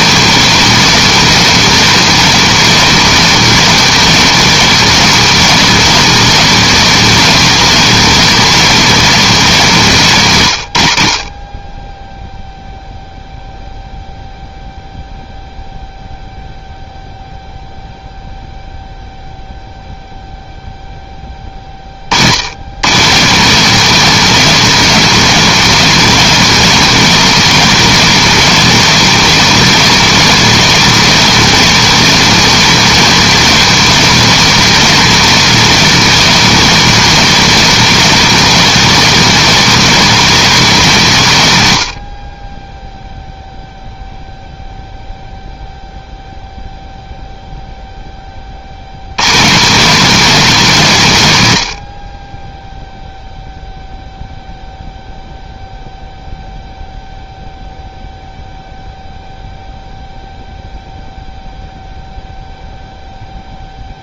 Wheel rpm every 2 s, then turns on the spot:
230, 230, 230, 230, 230, 110, 0, 0, 0, 0, 0, 130, 230, 230, 230, 230, 230, 230, 230, 230, 200, 10, 0, 0, 80, 180, 0, 0, 0, 0, 0, 0.
none